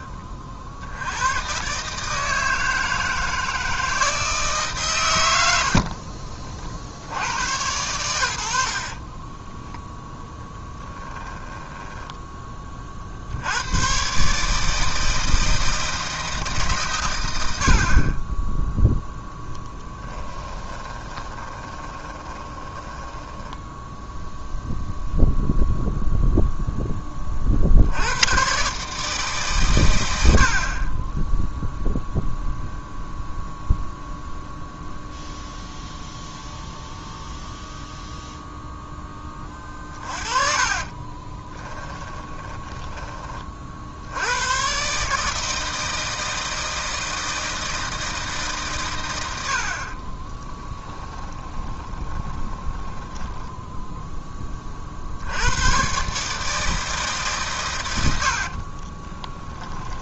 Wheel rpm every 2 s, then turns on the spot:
60, 160, 120, 90, 40, 10, 40, 160, 130, 0, 20, 10, 0, 10, 150, 30, 0, 0, 0, 10, 30, 20, 140, 160, 110, 10, 20, 50, 150, 30.
8-12 20-24 40-42 50-54 58-60